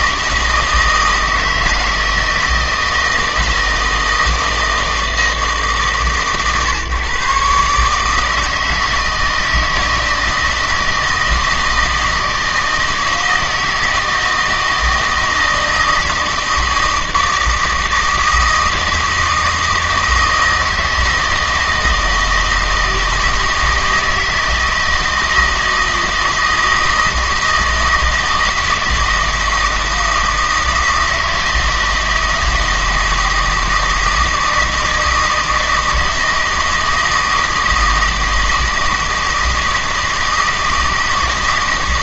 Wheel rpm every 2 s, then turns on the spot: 160, 160, 160, 130, 160, 160, 160, 160, 160, 160, 160, 160, 160, 160, 160, 160, 160, 160, 160, 160, 160.
none